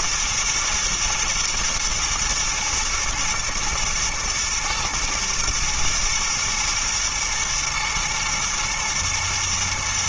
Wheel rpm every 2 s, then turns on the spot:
120, 110, 110, 110, 110.
none